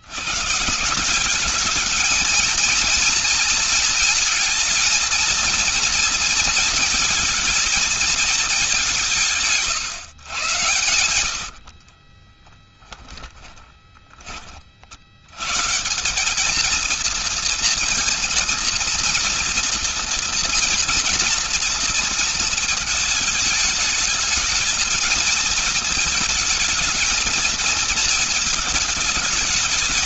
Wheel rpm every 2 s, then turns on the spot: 180, 230, 230, 220, 190, 90, 10, 70, 230, 230, 230, 220, 220, 220, 220.
8-14